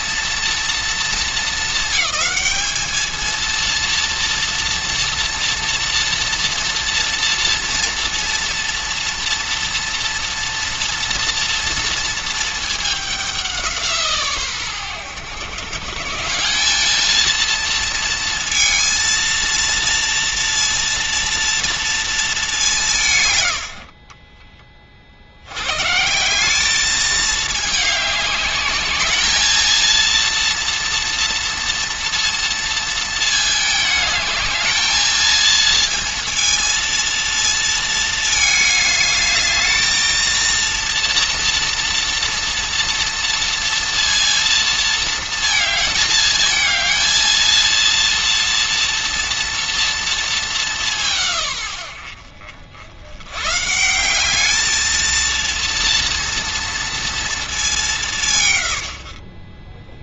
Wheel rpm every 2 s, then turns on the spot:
230, 220, 230, 240, 240, 230, 220, 120, 190, 230, 230, 200, 30, 210, 210, 230, 230, 220, 230, 220, 230, 230, 230, 220, 230, 200, 60, 220, 230, 120.
none